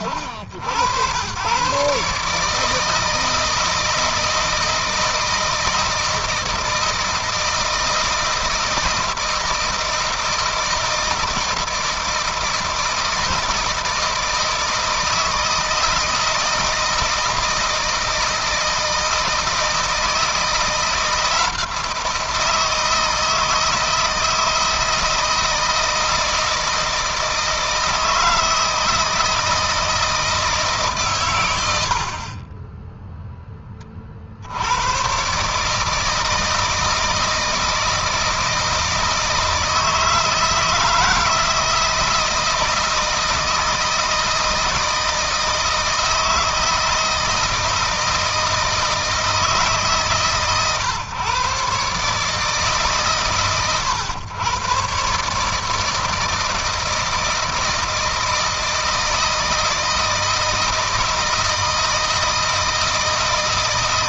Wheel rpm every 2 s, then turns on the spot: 100, 160, 160, 160, 160, 160, 160, 160, 160, 160, 170, 170, 160, 160, 160, 140, 0, 100, 160, 160, 160, 160, 160, 160, 160, 130, 140, 130, 160, 160, 160, 160.
none